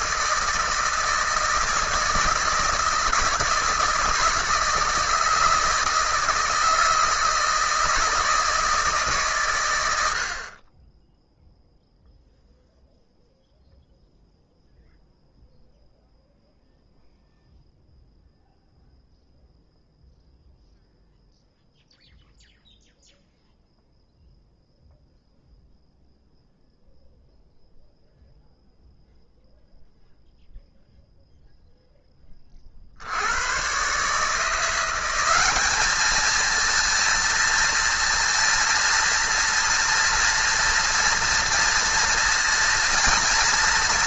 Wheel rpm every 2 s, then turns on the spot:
160, 160, 160, 160, 150, 20, 0, 0, 0, 0, 0, 0, 0, 0, 0, 0, 60, 180, 230, 230, 230, 230.
none